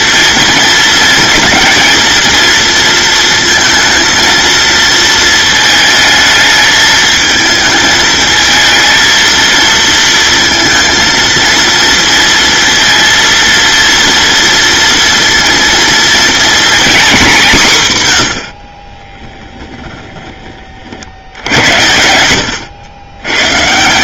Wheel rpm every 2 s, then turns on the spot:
230, 230, 230, 220, 220, 230, 230, 230, 220, 20, 60, 110.
18-20